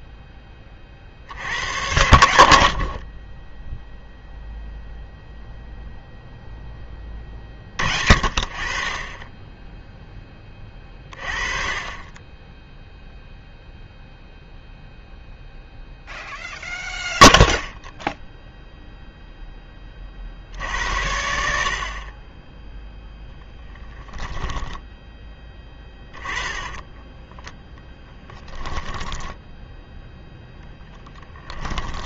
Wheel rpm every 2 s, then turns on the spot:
30, 80, 0, 10, 30, 30, 10, 0, 0, 0, 60, 10, 10, 20, 10, 0.
24-30